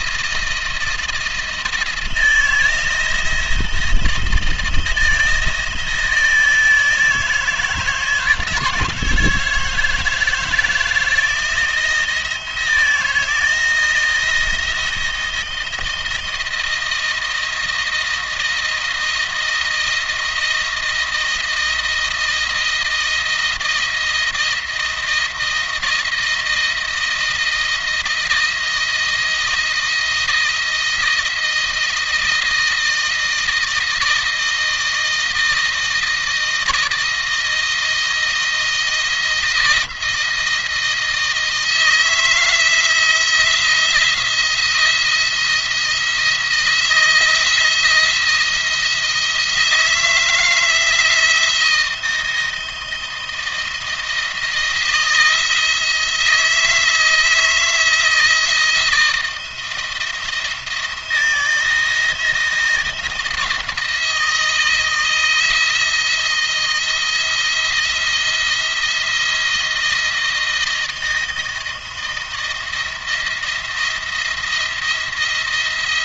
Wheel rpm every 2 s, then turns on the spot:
160, 160, 170, 160, 160, 160, 160, 170, 160, 160, 160, 160, 160, 160, 160, 160, 160, 160, 160, 160, 160, 170, 170, 160, 170, 160, 160, 170, 160, 160, 170, 170, 160, 170, 170, 160, 170, 170.
none